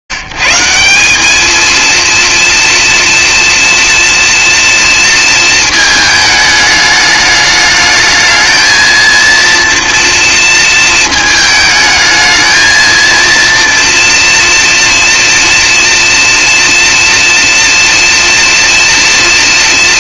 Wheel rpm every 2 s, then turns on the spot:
110, 230, 230, 210, 220, 230, 220, 230, 230, 230.
none